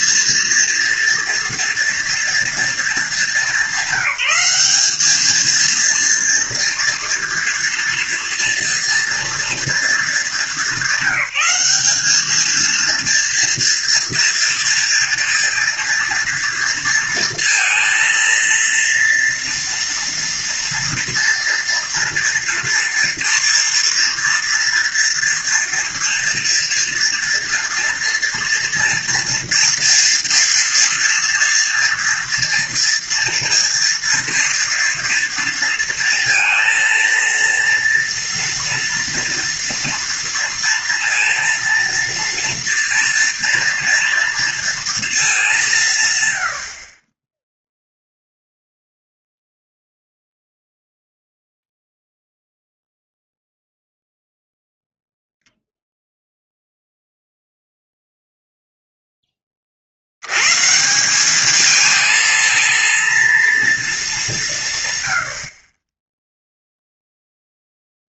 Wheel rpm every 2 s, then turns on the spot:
230, 230, 200, 230, 230, 200, 230, 230, 230, 230, 240, 230, 230, 230, 230, 230, 230, 230, 230, 230, 230, 230, 230, 80, 0, 0, 0, 0, 0, 0, 130, 230, 160, 0.
none